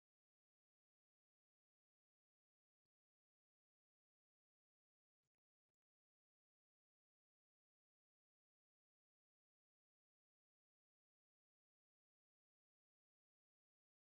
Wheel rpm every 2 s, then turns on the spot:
0, 0, 0, 0, 0, 0, 0.
none